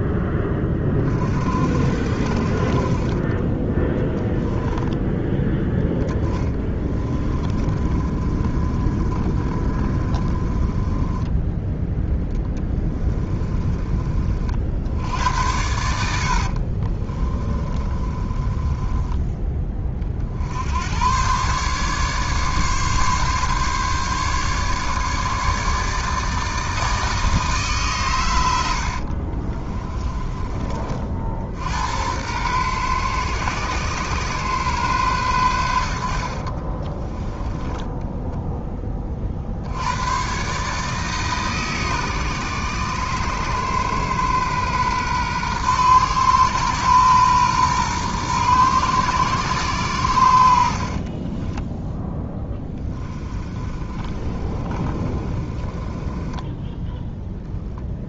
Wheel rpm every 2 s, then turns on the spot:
20, 30, 10, 20, 30, 20, 10, 60, 50, 20, 90, 140, 150, 160, 70, 30, 120, 130, 30, 10, 150, 120, 120, 120, 120, 50, 10, 30, 10.
6-14 16-20 28-30 36-38 50-56